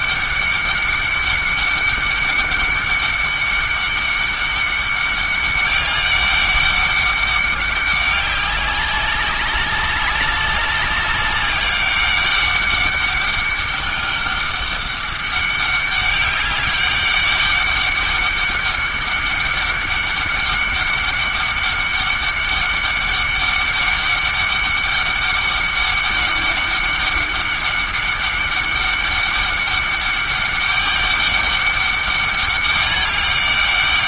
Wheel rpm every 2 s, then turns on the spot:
200, 200, 200, 200, 190, 200, 200, 200, 200, 200, 200, 200, 200, 200, 200, 200, 200.
none